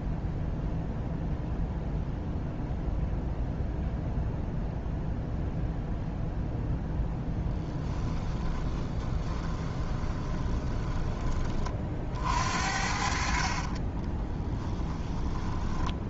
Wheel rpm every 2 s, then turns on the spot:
0, 0, 0, 0, 20, 20, 50, 10.
8-12 14-16